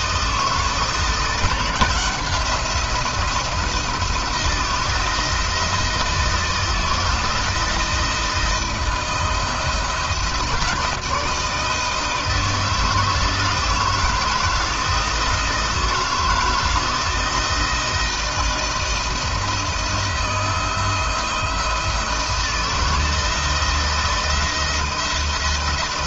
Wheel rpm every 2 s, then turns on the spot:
160, 180, 170, 170, 170, 160, 160, 160, 160, 160, 170, 160, 170.
none